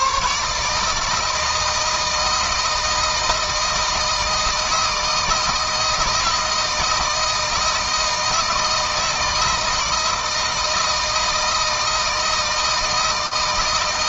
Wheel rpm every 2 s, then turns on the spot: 150, 160, 160, 160, 160, 160, 160.
none